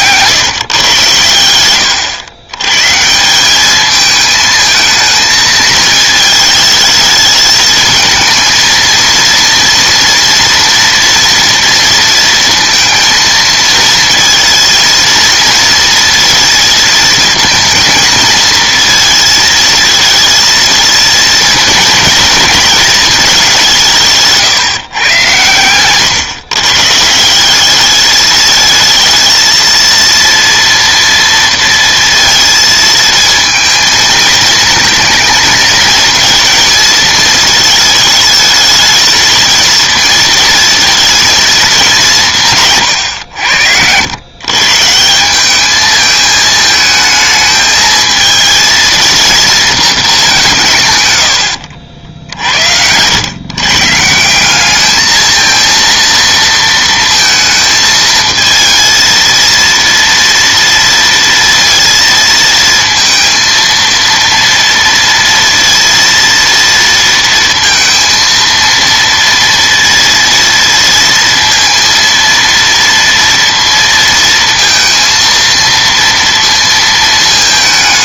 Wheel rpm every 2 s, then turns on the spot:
120, 130, 220, 220, 230, 230, 230, 230, 230, 230, 230, 220, 140, 150, 220, 230, 230, 230, 230, 220, 230, 130, 140, 220, 230, 140, 90, 210, 230, 230, 230, 230, 230, 230, 230, 230, 230, 230, 230.
none